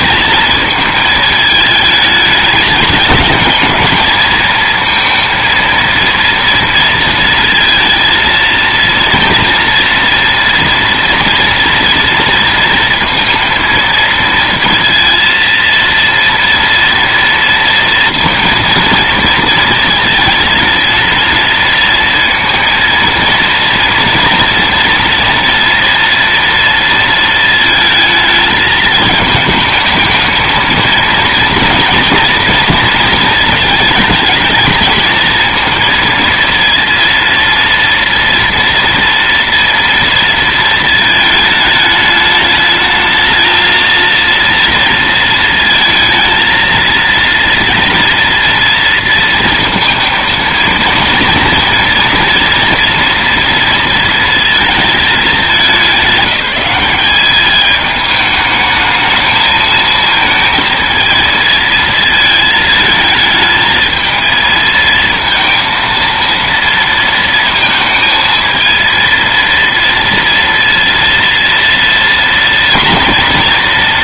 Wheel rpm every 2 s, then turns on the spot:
220, 220, 230, 230, 230, 240, 230, 230, 230, 240, 230, 230, 230, 230, 220, 230, 240, 220, 230, 230, 230, 220, 230, 230, 230, 230, 230, 220, 190, 220, 230, 220, 220, 230, 230, 230, 240.
none